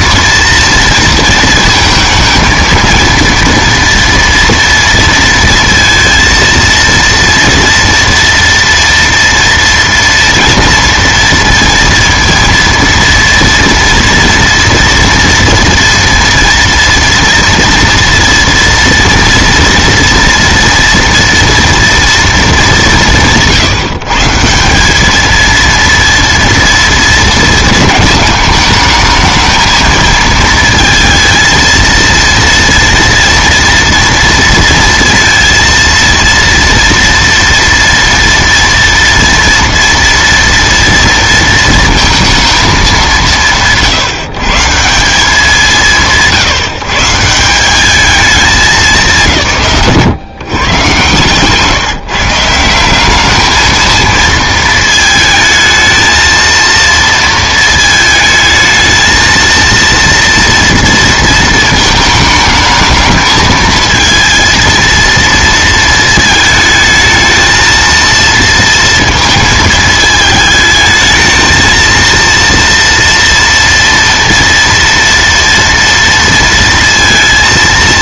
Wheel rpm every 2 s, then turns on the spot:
230, 230, 230, 230, 230, 230, 230, 230, 230, 230, 230, 210, 180, 230, 220, 220, 230, 230, 230, 230, 230, 220, 150, 160, 200, 130, 170, 220, 230, 220, 230, 220, 230, 220, 230, 220, 230, 230, 230.
none